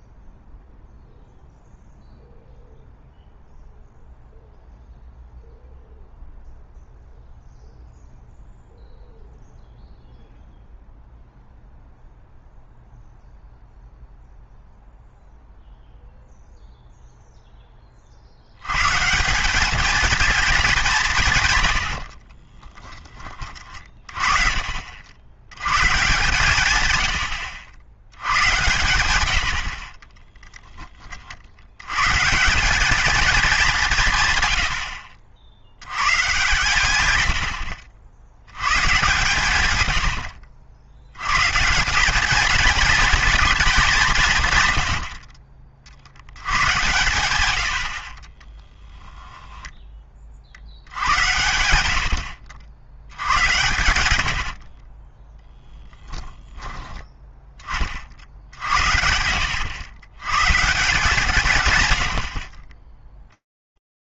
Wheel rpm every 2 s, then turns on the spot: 0, 0, 0, 0, 0, 0, 0, 0, 0, 100, 210, 30, 50, 120, 110, 20, 180, 100, 120, 110, 80, 220, 120, 100, 20, 60, 70, 60, 20, 70, 140, 30.
22-24 34-36 48-50 54-56 62-64